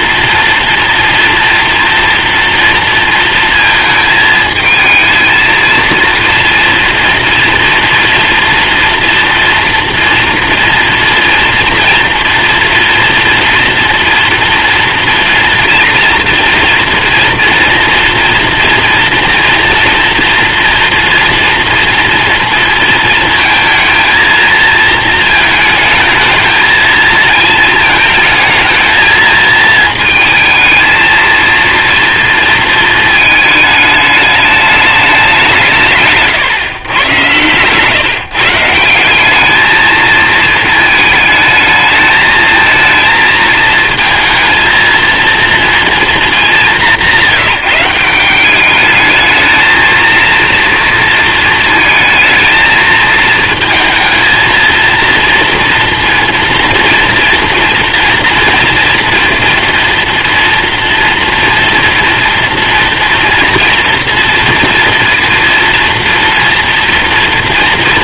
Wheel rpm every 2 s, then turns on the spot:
230, 230, 220, 230, 230, 230, 240, 230, 230, 230, 230, 230, 230, 220, 220, 220, 230, 210, 130, 160, 220, 220, 230, 180, 200, 230, 220, 230, 240, 230, 230, 230, 230, 240.
none